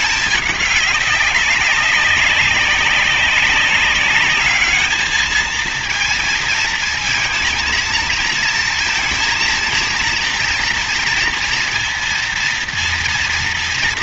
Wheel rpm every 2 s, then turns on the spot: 200, 200, 210, 230, 230, 230, 230.
none